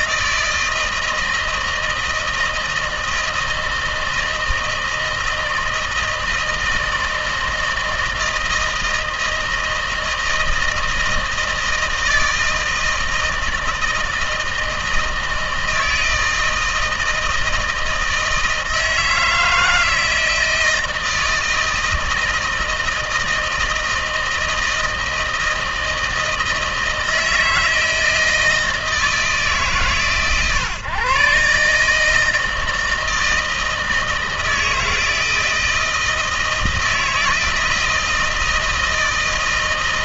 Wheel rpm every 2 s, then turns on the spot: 160, 160, 160, 160, 160, 160, 160, 160, 160, 160, 160, 160, 160, 160, 160, 140, 160, 160, 160, 160.
none